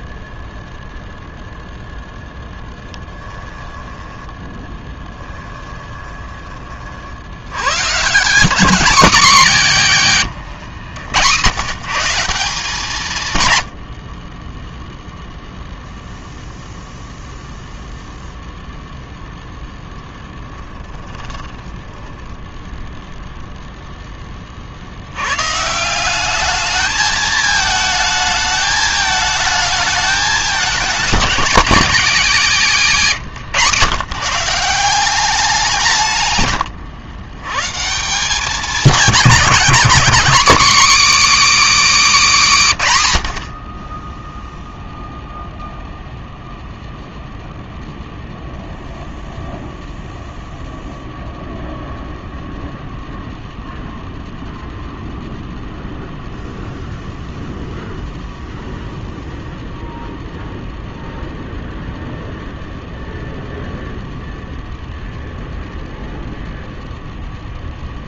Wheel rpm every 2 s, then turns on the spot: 0, 20, 10, 40, 240, 120, 170, 0, 0, 0, 10, 0, 70, 210, 220, 220, 200, 180, 100, 210, 280, 160, 0, 0, 0, 0, 0, 0, 0, 0, 0, 0, 0, 0.
2-6 20-22 36-38